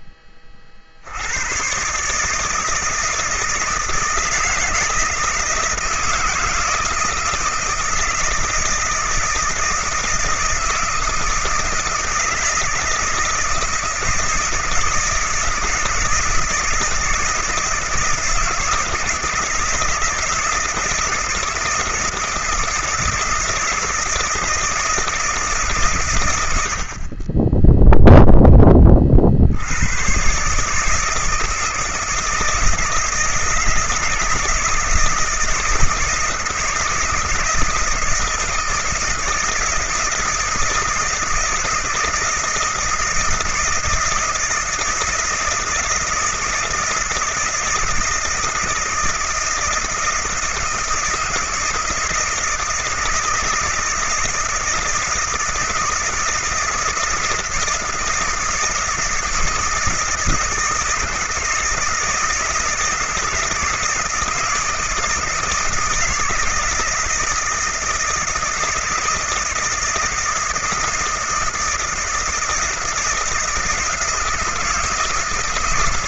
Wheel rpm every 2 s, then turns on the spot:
30, 160, 170, 160, 160, 170, 160, 160, 160, 160, 160, 160, 160, 130, 20, 140, 160, 170, 160, 160, 160, 160, 160, 160, 160, 160, 160, 160, 160, 160, 170, 160, 160, 160, 160, 160, 160, 160.
none